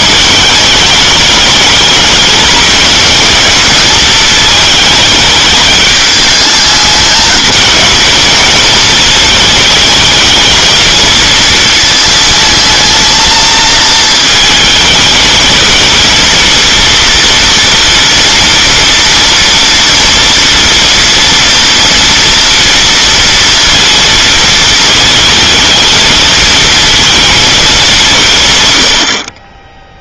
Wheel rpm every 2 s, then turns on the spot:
210, 220, 220, 210, 230, 220, 220, 220, 230, 230, 240, 230, 220, 230, 120.
none